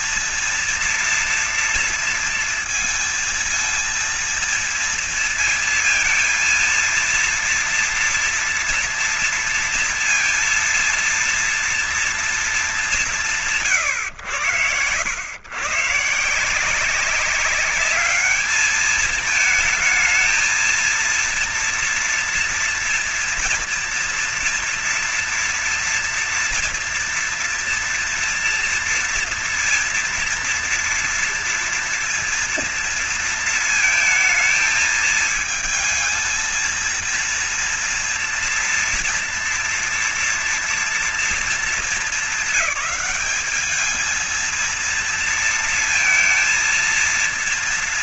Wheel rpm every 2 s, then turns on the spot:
230, 230, 230, 230, 230, 230, 210, 90, 180, 210, 230, 230, 230, 230, 230, 230, 230, 220, 230, 230, 230, 210, 230, 230.
none